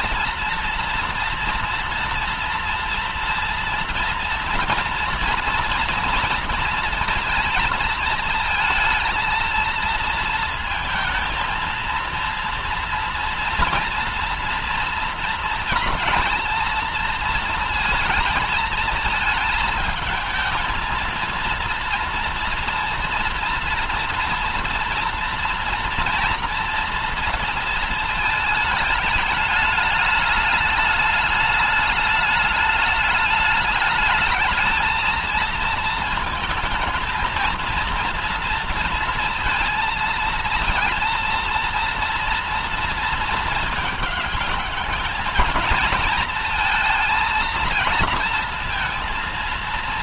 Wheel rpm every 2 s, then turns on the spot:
230, 230, 230, 230, 220, 220, 230, 230, 230, 230, 230, 240, 240, 240, 210, 210, 210, 220, 220, 230, 220, 230, 210, 230, 230.
none